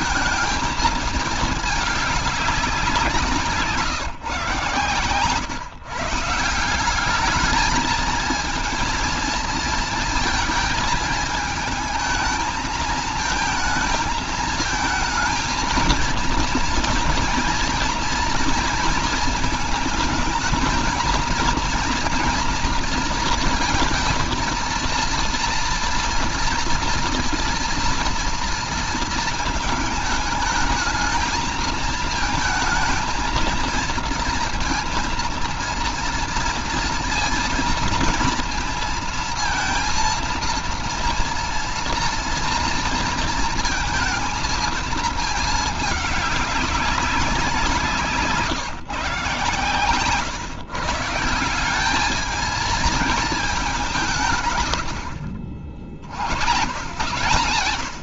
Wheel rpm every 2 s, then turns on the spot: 220, 190, 130, 180, 230, 230, 220, 220, 230, 230, 220, 240, 230, 230, 230, 220, 220, 230, 230, 230, 230, 230, 220, 200, 160, 130, 220, 100, 100.
none